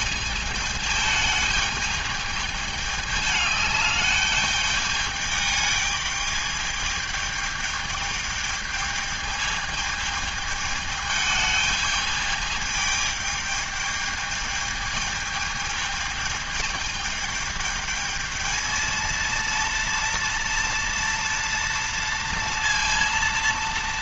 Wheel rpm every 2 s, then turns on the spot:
210, 210, 210, 210, 220, 210, 210, 210, 210, 220, 230, 230.
none